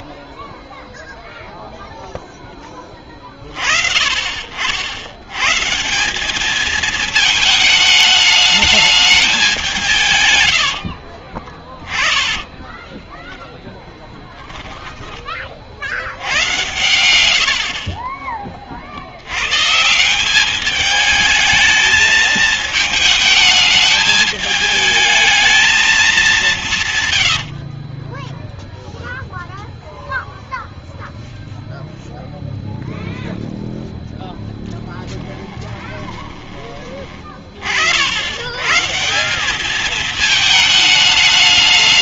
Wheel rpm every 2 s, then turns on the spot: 0, 0, 50, 200, 210, 110, 10, 10, 100, 40, 200, 220, 210, 200, 10, 0, 0, 0, 20, 110, 210.
10-18 28-30